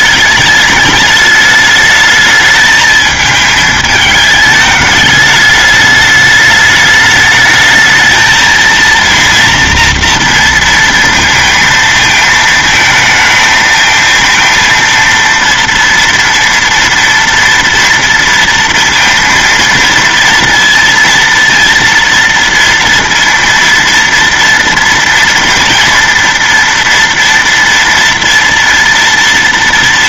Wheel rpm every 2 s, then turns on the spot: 210, 220, 210, 210, 230, 230, 220, 230, 230, 230, 230, 230, 230, 230, 230.
none